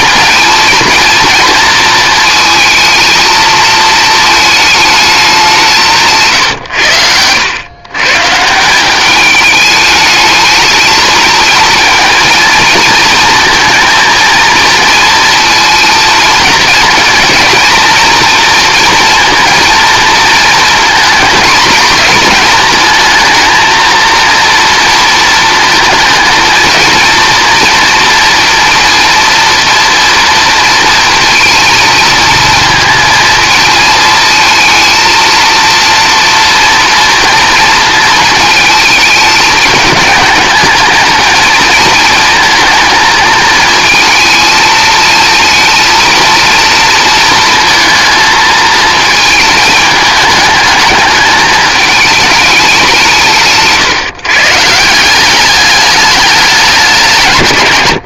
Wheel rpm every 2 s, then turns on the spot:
230, 220, 220, 100, 180, 220, 220, 230, 230, 230, 230, 220, 230, 230, 230, 230, 220, 230, 230, 220, 220, 230, 220, 230, 220, 210, 190, 150, 190.
none